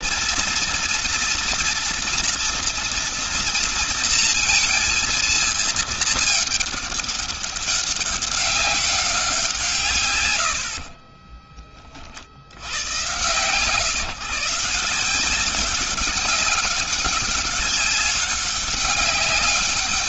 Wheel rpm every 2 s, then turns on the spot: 230, 230, 230, 200, 180, 40, 120, 180, 200, 200.
10-12